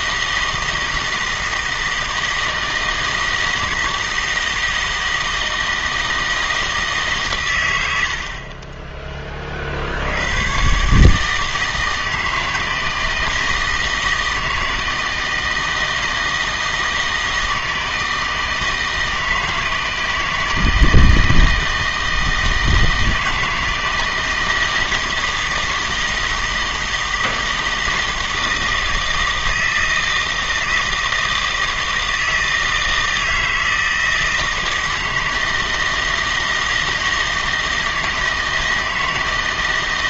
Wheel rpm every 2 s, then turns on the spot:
160, 160, 160, 160, 20, 140, 160, 160, 160, 160, 160, 160, 160, 160, 160, 160, 160, 160, 160, 160.
none